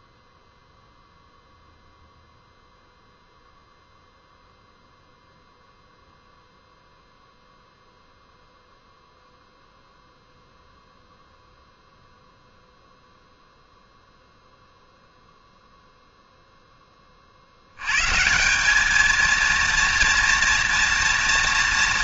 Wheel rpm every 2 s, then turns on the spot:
0, 0, 0, 0, 0, 0, 0, 0, 10, 210, 240.
none